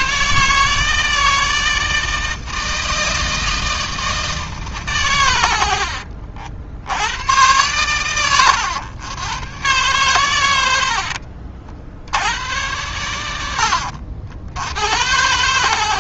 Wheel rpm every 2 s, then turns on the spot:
160, 160, 150, 70, 110, 80, 110, 90.
10-12